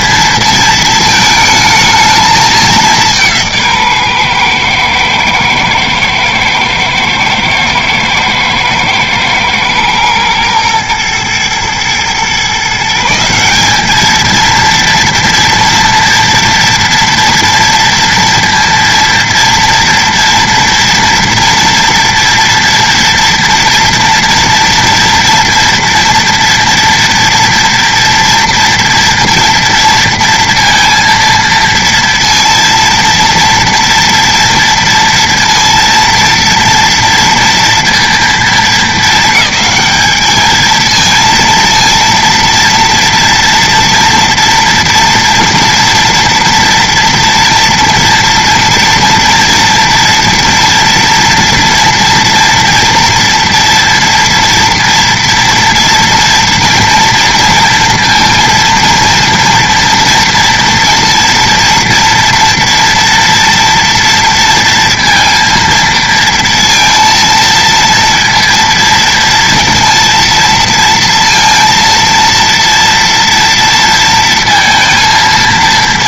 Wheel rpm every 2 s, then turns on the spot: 220, 200, 120, 110, 110, 120, 150, 230, 230, 230, 230, 230, 230, 240, 230, 230, 230, 230, 230, 220, 220, 230, 230, 230, 230, 230, 240, 230, 230, 230, 230, 230, 230, 230, 230, 230, 230, 230.
none